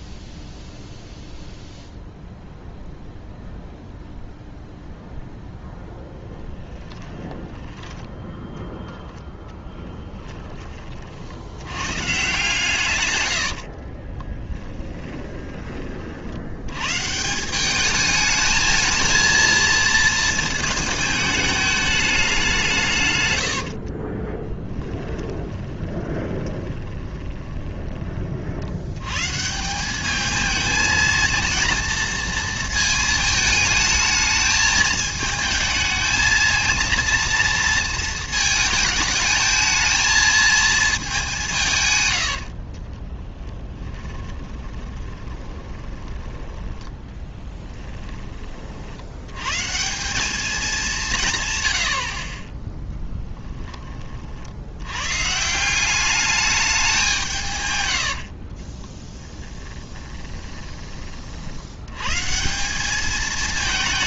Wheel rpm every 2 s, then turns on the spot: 0, 0, 0, 10, 10, 20, 130, 20, 100, 220, 220, 160, 10, 20, 70, 220, 220, 220, 230, 220, 220, 60, 20, 20, 50, 200, 10, 90, 200, 30, 20, 190.
6-8 14-16 24-28 42-46 58-60